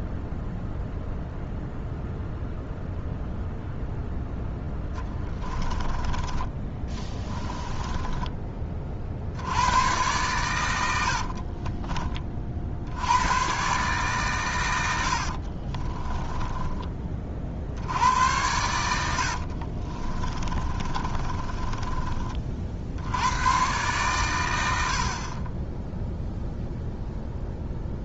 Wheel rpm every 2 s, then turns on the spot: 0, 0, 10, 20, 50, 90, 80, 90, 20, 90, 30, 60, 70, 0.
4-8 18-22